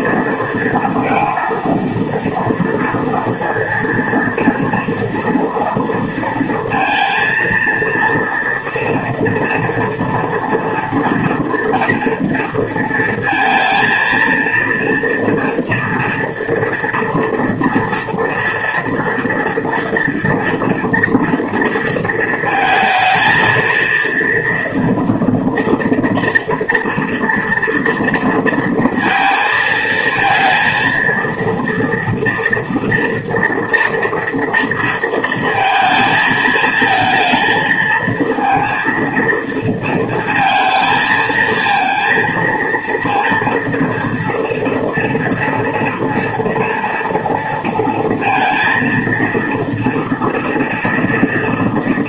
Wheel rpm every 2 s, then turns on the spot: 230, 230, 230, 230, 230, 230, 230, 230, 230, 230, 240, 220, 230, 230, 230, 230, 230, 230, 220, 230, 230, 230, 230, 230, 230, 230.
none